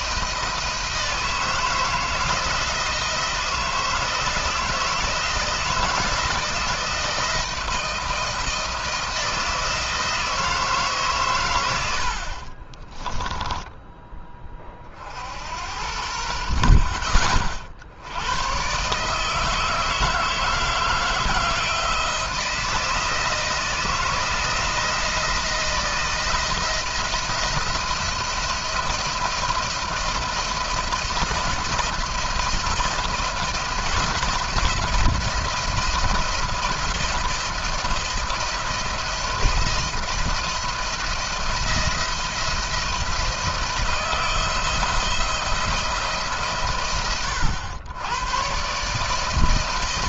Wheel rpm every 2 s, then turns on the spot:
160, 160, 160, 160, 160, 160, 40, 30, 50, 120, 160, 160, 170, 170, 170, 170, 170, 170, 170, 170, 170, 170, 170, 130, 130.
12-14